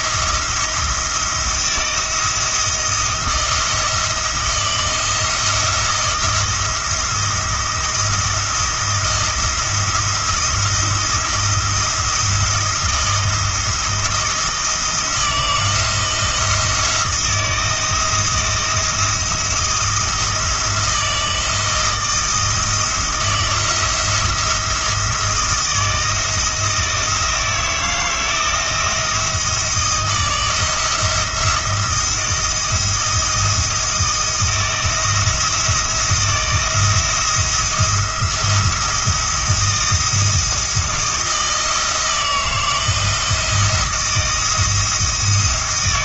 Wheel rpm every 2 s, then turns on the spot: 170, 160, 170, 170, 170, 160, 170, 170, 170, 160, 160, 160, 160, 160, 160, 160, 170, 170, 160, 170, 160, 160, 160.
none